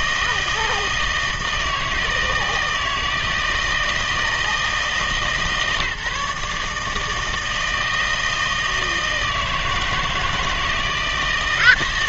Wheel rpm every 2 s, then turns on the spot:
160, 160, 160, 150, 160, 160.
none